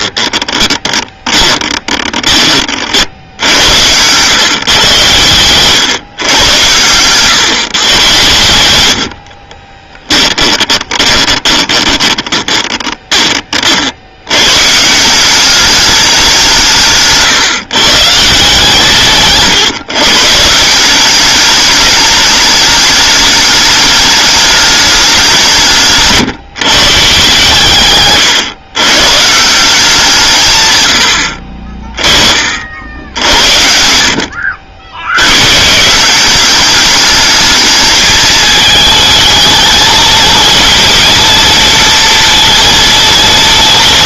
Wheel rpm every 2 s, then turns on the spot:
10, 50, 120, 110, 90, 20, 20, 150, 160, 140, 170, 210, 210, 140, 110, 110, 60, 70, 210, 220, 230, 230.
0-2 10-14